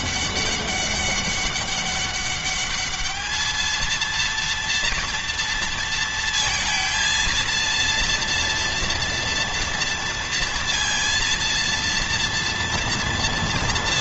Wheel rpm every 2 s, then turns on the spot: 200, 210, 230, 230, 230, 230, 230.
none